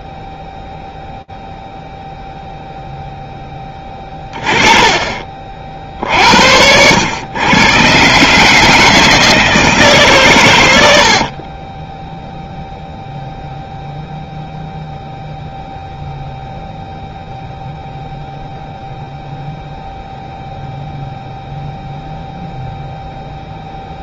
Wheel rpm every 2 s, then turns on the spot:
0, 0, 20, 60, 120, 160, 20, 0, 0, 0, 0, 0.
12-14